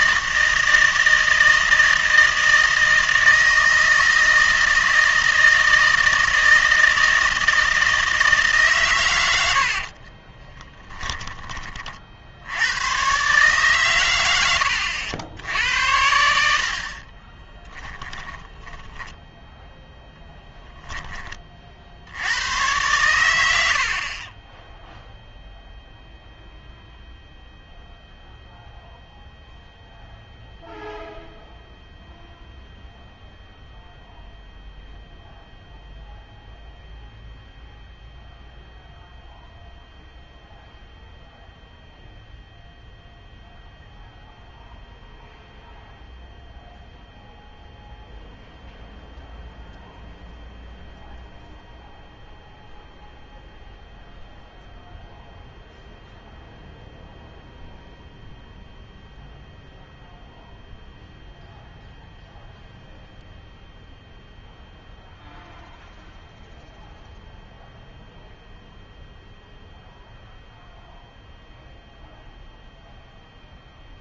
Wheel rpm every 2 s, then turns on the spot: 160, 160, 160, 160, 140, 20, 110, 80, 60, 10, 10, 110, 0, 0, 0, 0, 0, 0, 0, 0, 0, 0, 0, 0, 0, 0, 0, 0, 0, 0, 0, 0, 0, 0, 0, 0, 0.
10-12 18-20